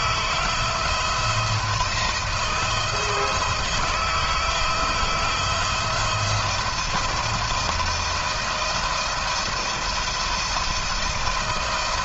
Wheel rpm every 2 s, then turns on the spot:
170, 160, 170, 170, 170, 170.
none